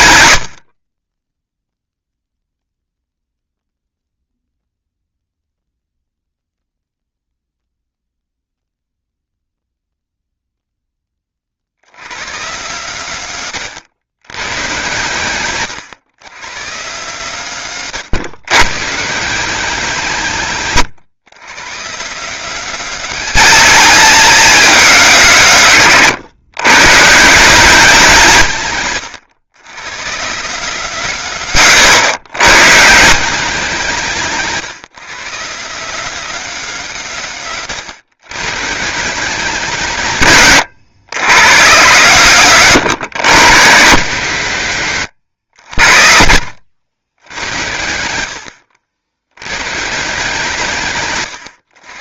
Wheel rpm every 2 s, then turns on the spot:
30, 0, 0, 0, 0, 0, 140, 120, 150, 130, 140, 210, 210, 130, 150, 170, 130, 170, 190, 150, 130, 150, 140, 100, 70, 150.
20-22 28-30